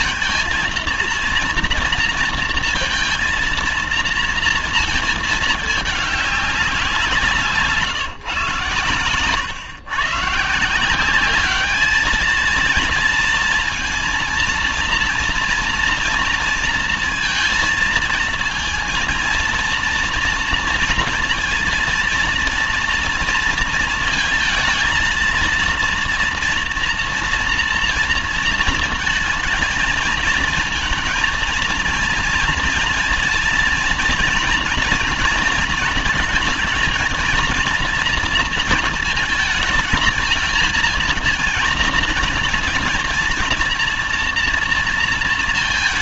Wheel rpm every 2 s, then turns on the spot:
230, 230, 230, 180, 110, 170, 230, 230, 230, 230, 230, 230, 220, 240, 220, 220, 230, 230, 230, 230, 230, 230, 230.
8-10